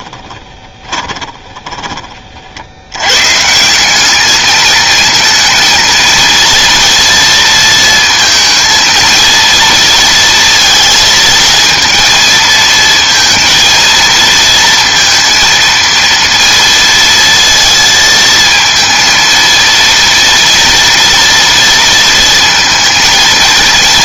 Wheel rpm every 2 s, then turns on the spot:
20, 70, 220, 230, 230, 220, 220, 230, 230, 230, 230, 230.
0-2